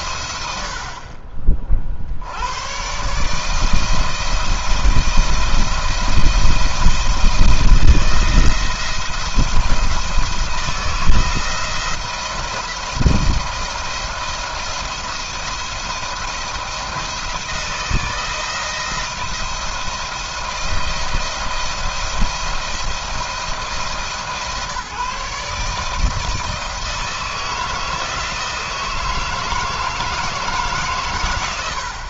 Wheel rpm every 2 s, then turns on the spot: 80, 120, 170, 170, 160, 160, 170, 170, 160, 160, 170, 170, 140, 160, 160, 140.
none